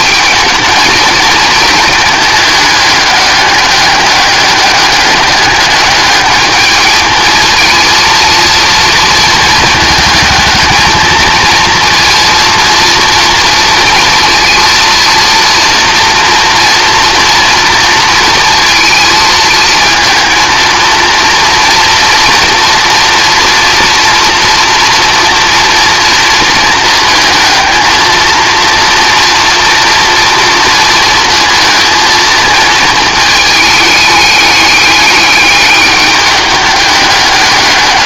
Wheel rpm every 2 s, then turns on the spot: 220, 200, 200, 210, 230, 220, 230, 230, 230, 230, 230, 230, 230, 230, 230, 230, 220, 210, 200.
none